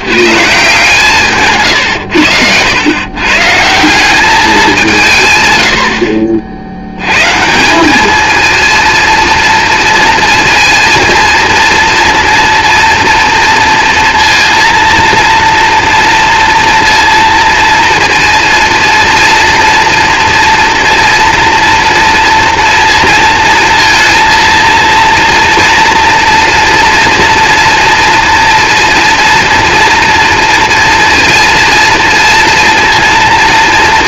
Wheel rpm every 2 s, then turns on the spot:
160, 110, 180, 80, 230, 230, 230, 230, 230, 230, 230, 230, 230, 240, 230, 230, 230.
none